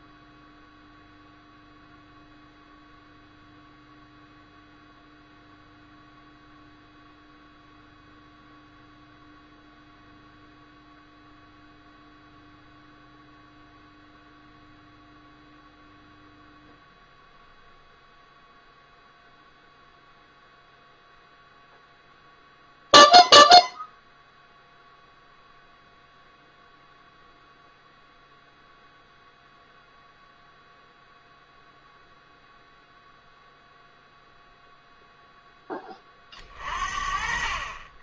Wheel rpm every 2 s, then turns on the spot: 0, 0, 0, 0, 0, 0, 0, 0, 0, 0, 0, 0, 0, 0, 0, 0, 0, 0, 40.
none